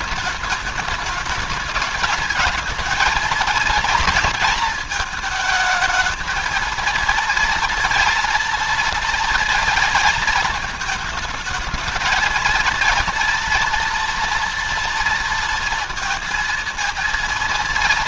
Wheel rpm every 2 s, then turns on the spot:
210, 220, 220, 230, 230, 210, 230, 230, 230.
none